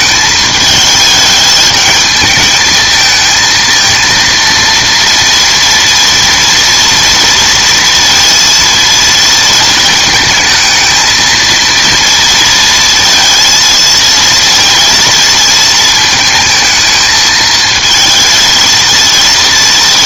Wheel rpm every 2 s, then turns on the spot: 220, 220, 230, 230, 230, 220, 230, 230, 220, 230.
none